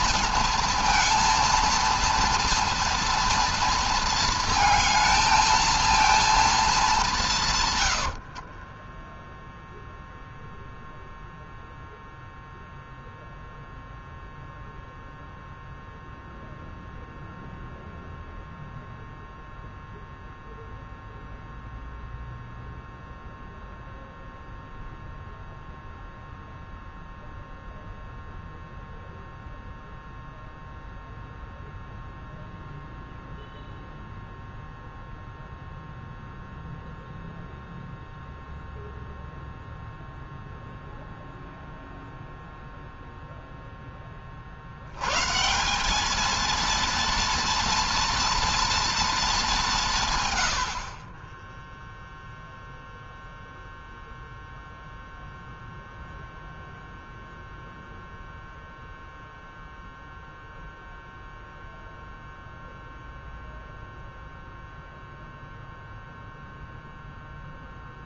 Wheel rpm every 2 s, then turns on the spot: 230, 230, 220, 210, 20, 0, 0, 0, 0, 0, 0, 0, 0, 0, 0, 0, 0, 0, 0, 0, 0, 0, 80, 230, 230, 70, 0, 0, 0, 0, 0, 0, 0, 0.
8-10